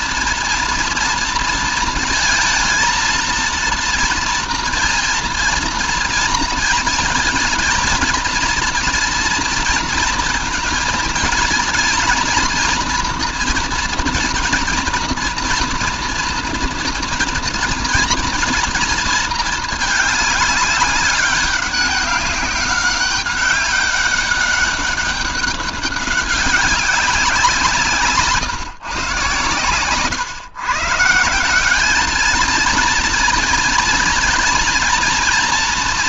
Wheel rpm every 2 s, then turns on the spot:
240, 230, 230, 230, 230, 230, 240, 230, 230, 230, 210, 200, 200, 190, 150, 130, 220, 230.
none